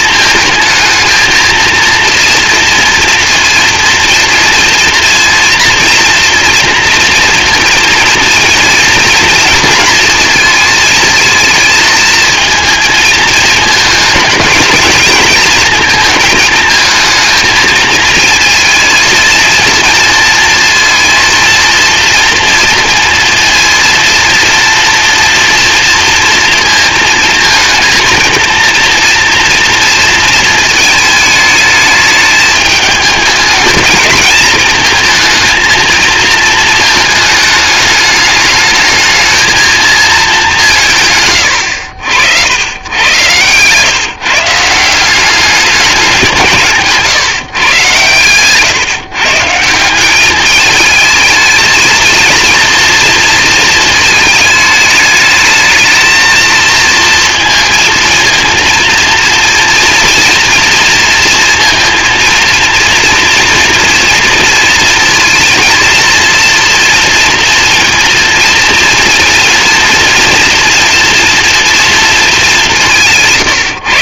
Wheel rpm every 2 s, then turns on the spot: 220, 230, 230, 230, 230, 230, 230, 220, 220, 220, 230, 230, 230, 230, 230, 220, 220, 220, 220, 210, 170, 100, 170, 150, 140, 210, 230, 210, 230, 220, 230, 230, 230, 230, 230, 230, 190.
none